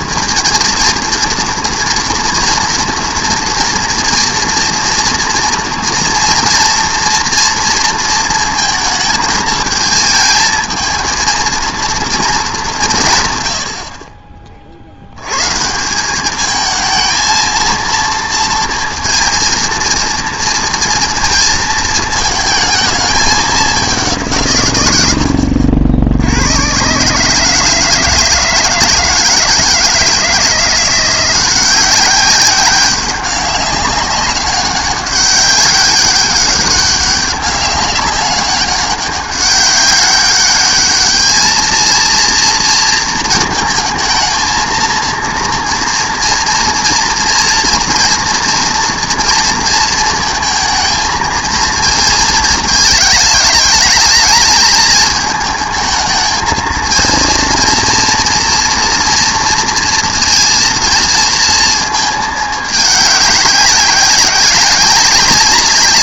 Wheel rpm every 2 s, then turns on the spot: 230, 230, 230, 240, 230, 220, 210, 40, 210, 230, 230, 220, 140, 100, 160, 170, 190, 200, 200, 190, 200, 230, 230, 240, 230, 220, 220, 220, 220, 240, 230, 210, 190.
none